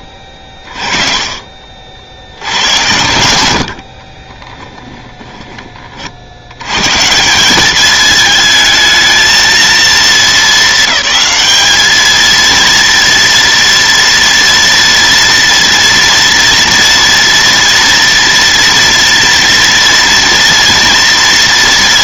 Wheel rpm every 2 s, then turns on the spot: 50, 80, 20, 100, 220, 210, 230, 230, 230, 230, 230.
4-6